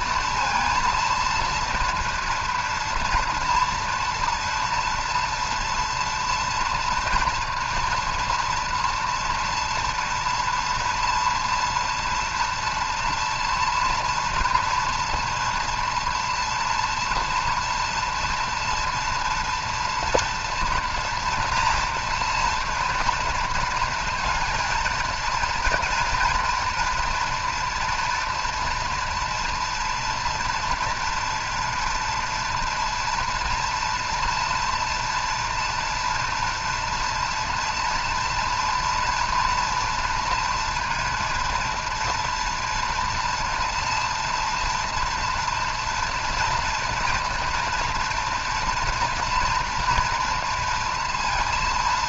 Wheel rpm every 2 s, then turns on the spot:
230, 230, 230, 240, 240, 230, 230, 230, 240, 230, 240, 240, 230, 240, 230, 230, 240, 230, 230, 230, 230, 240, 230, 230, 240, 230.
none